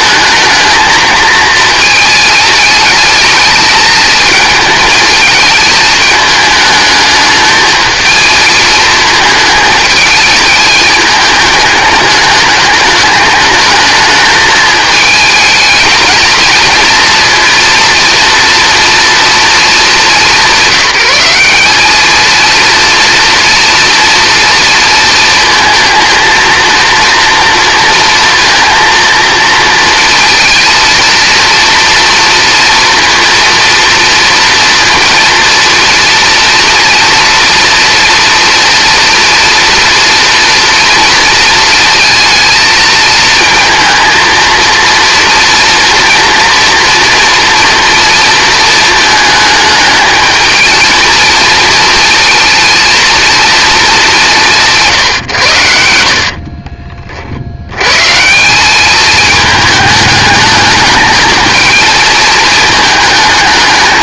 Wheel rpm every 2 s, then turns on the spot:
230, 220, 220, 210, 220, 210, 210, 220, 220, 240, 190, 230, 230, 230, 230, 230, 230, 230, 230, 230, 230, 220, 230, 230, 230, 220, 230, 160, 50, 190, 210, 220.
56-58